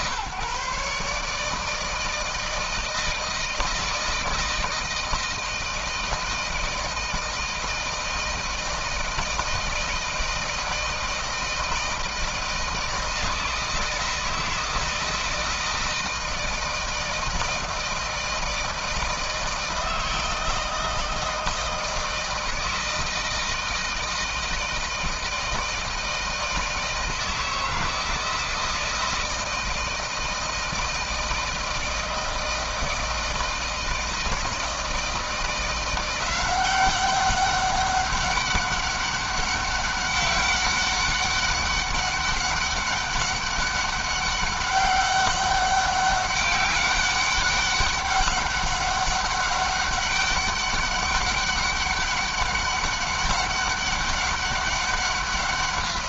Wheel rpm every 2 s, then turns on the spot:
140, 160, 160, 160, 160, 160, 160, 160, 160, 160, 160, 160, 160, 160, 160, 160, 160, 160, 190, 200, 200, 200, 200, 200, 200, 200, 200, 200.
none